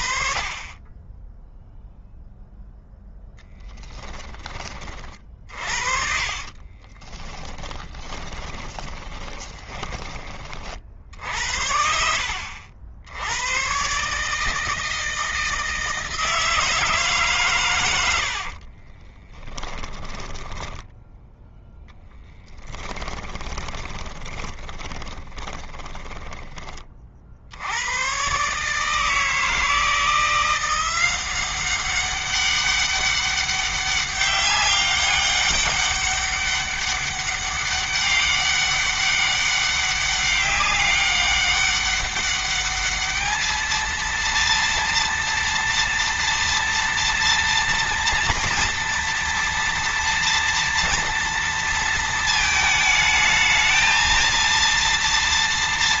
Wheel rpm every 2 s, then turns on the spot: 20, 0, 40, 30, 20, 60, 80, 160, 150, 30, 10, 10, 20, 40, 150, 180, 200, 200, 200, 200, 200, 210, 230, 230, 230, 230, 220, 230.
6-10 18-20 22-26